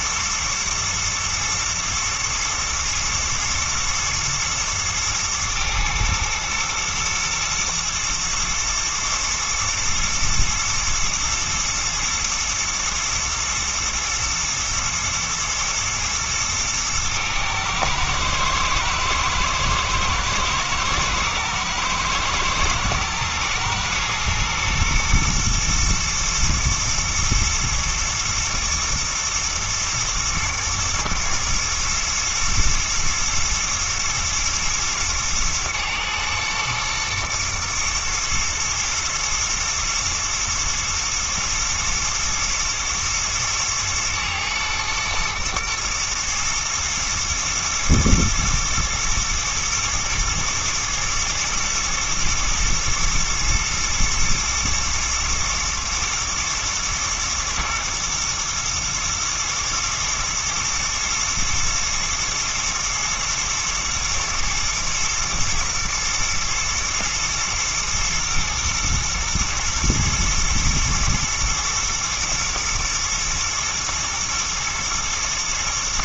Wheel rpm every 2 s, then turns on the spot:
110, 120, 110, 110, 120, 120, 110, 120, 110, 120, 120, 110, 110, 110, 120, 110, 110, 120, 120, 120, 110, 110, 110, 110, 110, 110, 110, 120, 120, 110, 110, 110, 110, 120, 120, 120, 120, 120.
none